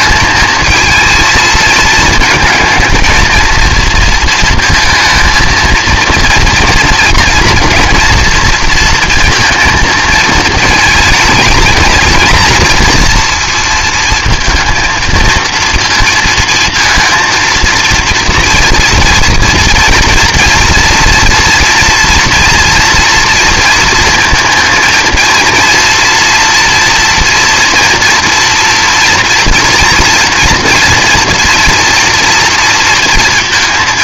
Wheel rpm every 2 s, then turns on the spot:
220, 220, 220, 240, 240, 220, 230, 230, 230, 230, 230, 230, 230, 240, 230, 230, 230.
none